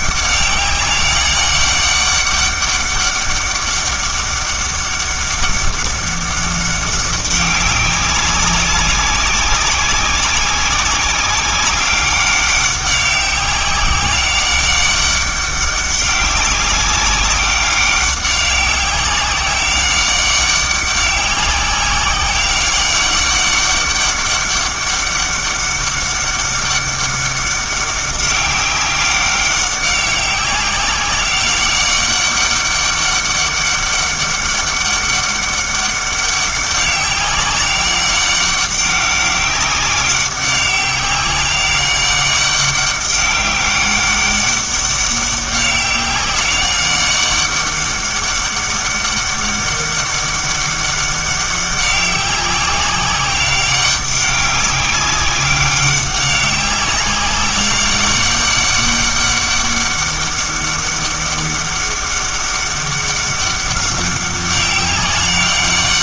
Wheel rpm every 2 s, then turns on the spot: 200, 200, 200, 200, 190, 190, 200, 200, 190, 200, 200, 190, 200, 200, 200, 190, 200, 200, 200, 200, 190, 200, 200, 190, 200, 200, 200, 190, 200, 200, 200, 200, 200.
none